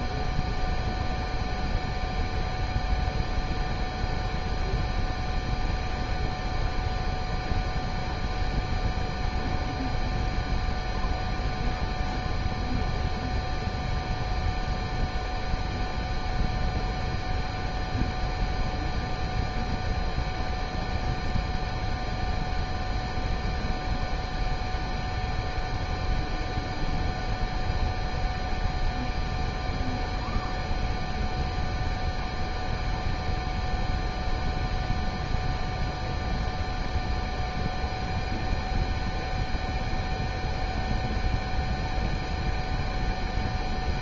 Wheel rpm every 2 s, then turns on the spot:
0, 0, 0, 0, 0, 0, 0, 0, 0, 0, 0, 0, 0, 0, 0, 0, 0, 0, 0, 0, 0, 0.
none